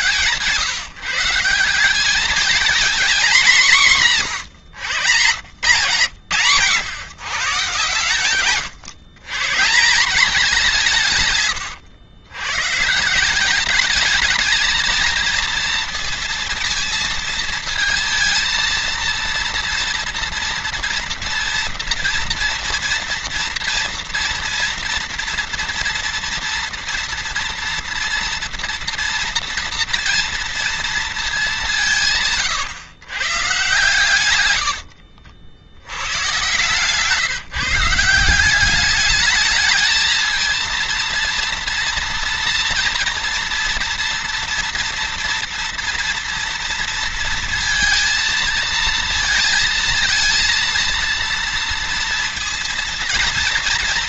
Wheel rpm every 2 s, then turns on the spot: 140, 220, 140, 150, 130, 180, 130, 220, 230, 230, 230, 230, 230, 230, 230, 230, 140, 100, 140, 190, 220, 230, 240, 230, 230, 230, 230.
34-36